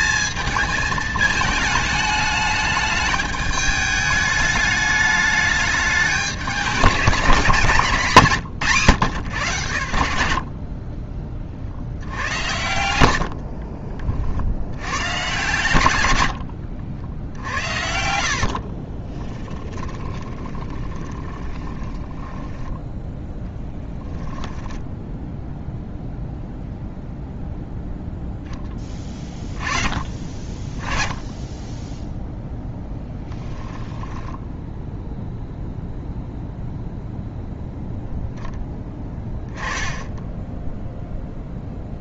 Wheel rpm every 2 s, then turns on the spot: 220, 210, 210, 200, 140, 30, 90, 90, 70, 40, 20, 10, 10, 0, 20, 20, 0, 10, 0, 10, 0.
10-14 18-22 24-26